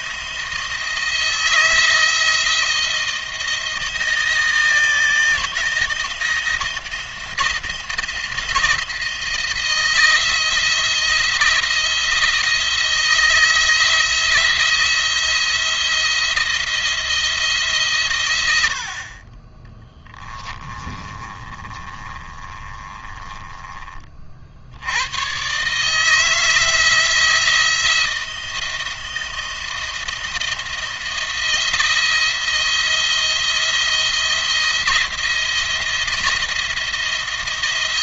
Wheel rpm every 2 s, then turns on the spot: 160, 170, 160, 170, 170, 170, 170, 170, 170, 70, 20, 20, 90, 170, 170, 160, 170, 170, 170.
20-24